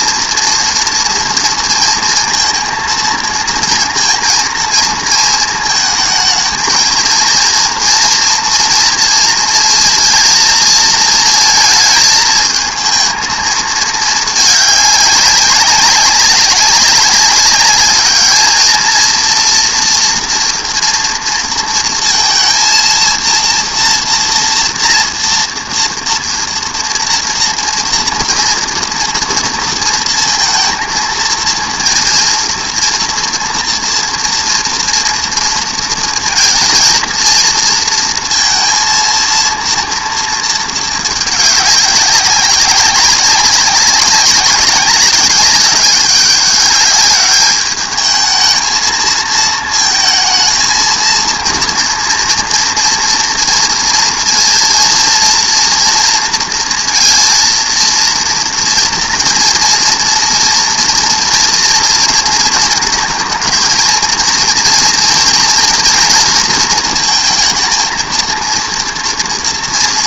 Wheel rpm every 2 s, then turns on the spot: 230, 230, 230, 220, 230, 230, 220, 200, 200, 220, 230, 230, 230, 230, 230, 230, 230, 230, 230, 230, 220, 190, 190, 200, 220, 230, 240, 230, 230, 230, 230, 230, 230, 230, 230.
none